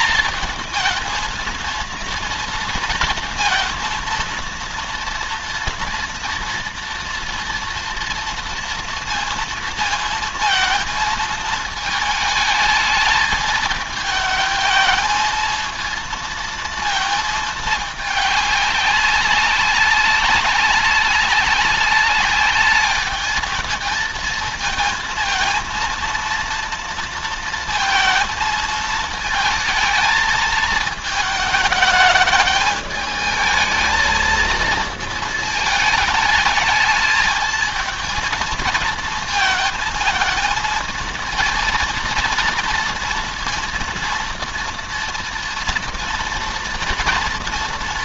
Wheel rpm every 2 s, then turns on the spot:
220, 230, 230, 230, 230, 230, 220, 220, 230, 200, 200, 200, 230, 230, 220, 220, 210, 220, 210, 230, 220, 230, 230, 230.
none